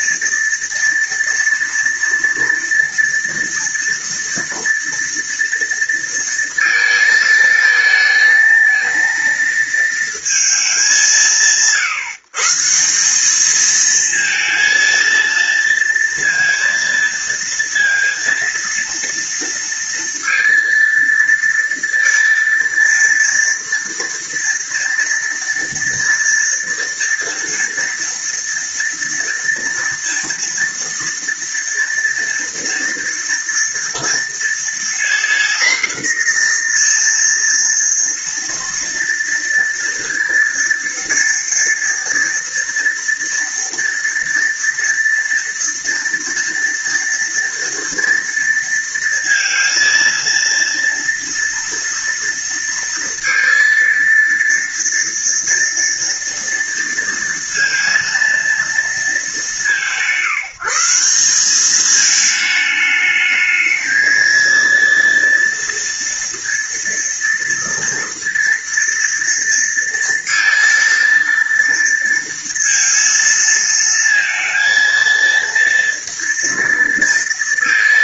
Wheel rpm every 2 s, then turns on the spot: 230, 230, 230, 220, 230, 180, 180, 230, 230, 230, 230, 230, 230, 230, 230, 230, 240, 240, 240, 230, 230, 230, 230, 230, 230, 230, 230, 230, 230, 210, 190, 220, 230, 230, 230, 230, 230, 230, 230.
none